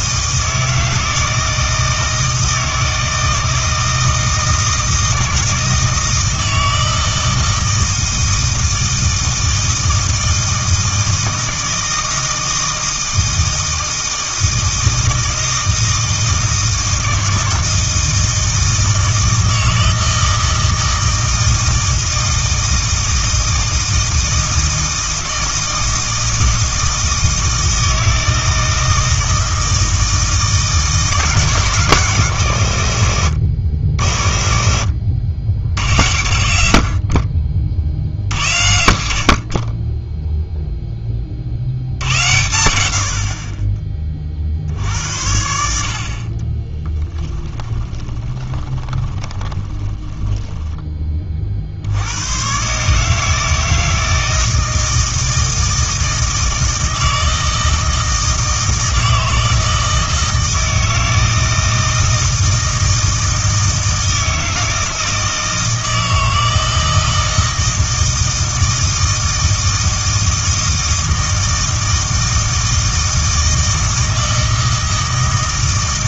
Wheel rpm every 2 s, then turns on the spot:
160, 160, 160, 160, 160, 160, 160, 160, 160, 160, 160, 160, 160, 160, 160, 160, 110, 70, 80, 90, 0, 90, 60, 20, 20, 20, 140, 160, 160, 160, 160, 160, 160, 160, 160, 160, 160, 160.
46-52